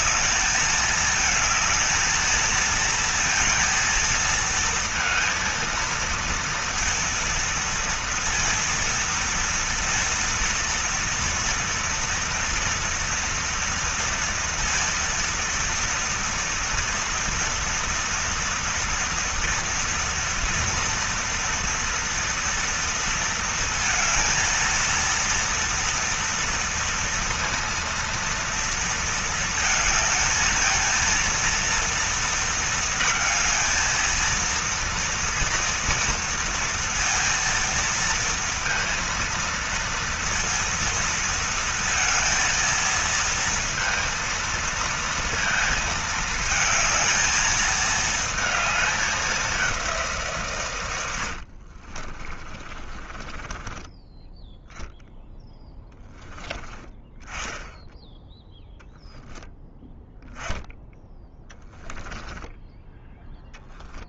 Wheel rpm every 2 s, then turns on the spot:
220, 230, 230, 230, 230, 230, 230, 230, 240, 230, 240, 230, 230, 230, 230, 220, 230, 230, 230, 230, 230, 230, 230, 220, 220, 130, 30, 0, 10, 10, 0, 10.
52-54